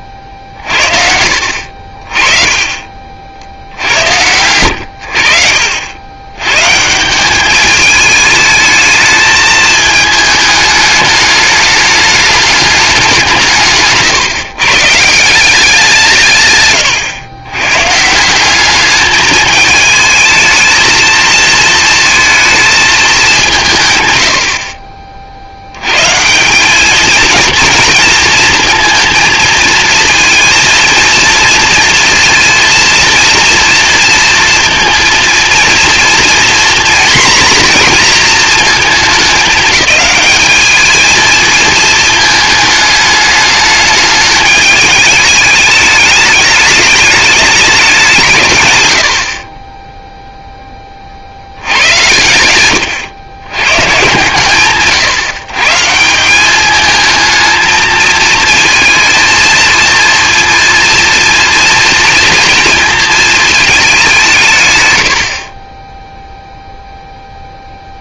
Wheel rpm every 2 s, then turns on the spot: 60, 40, 90, 140, 220, 210, 210, 150, 130, 210, 220, 220, 40, 210, 230, 230, 230, 230, 240, 220, 220, 210, 220, 210, 100, 20, 110, 140, 210, 220, 230, 230, 120, 0.
0-2